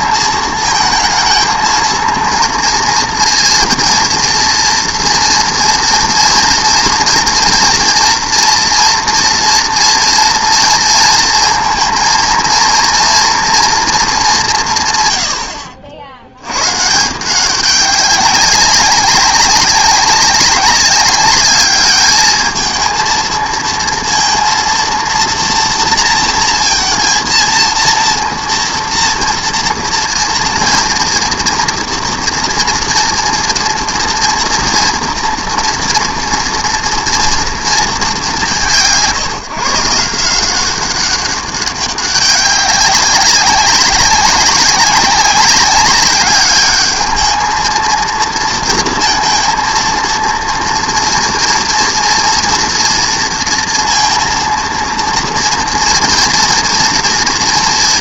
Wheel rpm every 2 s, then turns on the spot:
230, 230, 240, 230, 230, 230, 230, 70, 190, 200, 210, 230, 230, 230, 230, 230, 230, 230, 200, 150, 200, 190, 200, 230, 230, 240, 230, 230, 230.
none